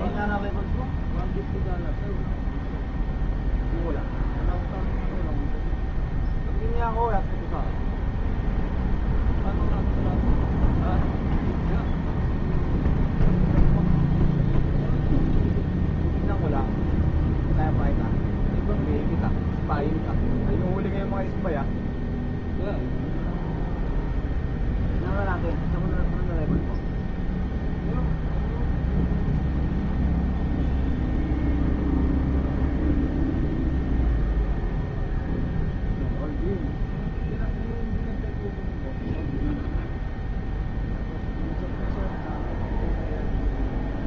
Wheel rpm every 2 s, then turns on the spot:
0, 0, 0, 0, 0, 0, 0, 0, 0, 0, 0, 0, 0, 0, 0, 0, 0, 0, 0, 0, 0, 0.
none